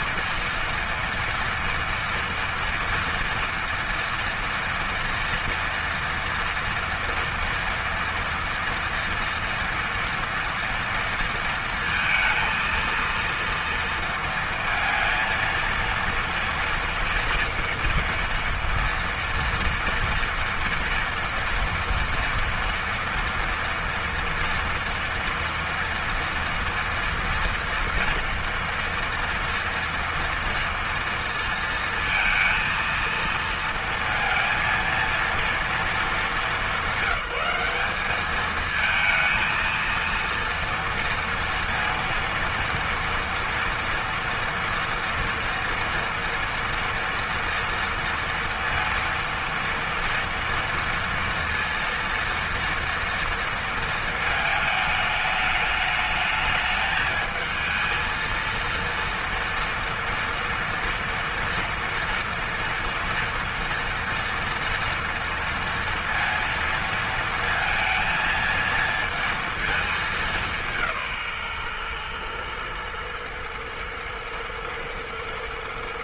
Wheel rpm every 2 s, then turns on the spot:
230, 230, 230, 230, 240, 230, 230, 230, 230, 230, 230, 230, 230, 230, 230, 230, 230, 230, 200, 220, 230, 230, 230, 230, 230, 230, 230, 210, 220, 230, 230, 230, 230, 230, 230, 160, 110, 110.
none